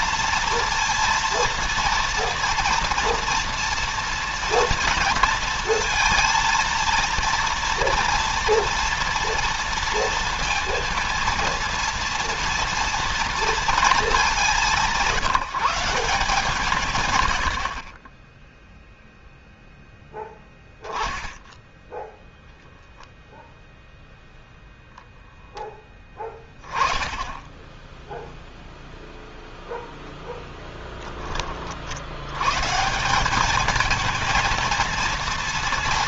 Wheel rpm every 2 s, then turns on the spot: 230, 230, 230, 230, 230, 230, 230, 170, 130, 0, 0, 10, 0, 10, 0, 10, 170, 230.
none